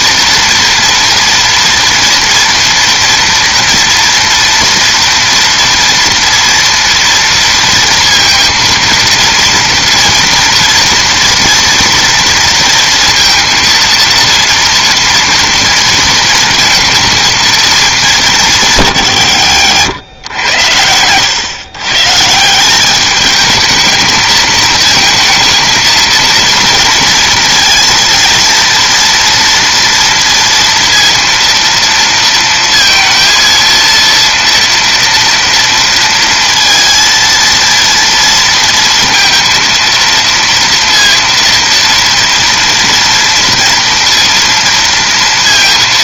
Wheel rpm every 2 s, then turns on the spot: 230, 240, 230, 230, 230, 230, 230, 230, 220, 140, 100, 190, 230, 230, 230, 230, 230, 230, 230, 230, 230, 230, 230.
none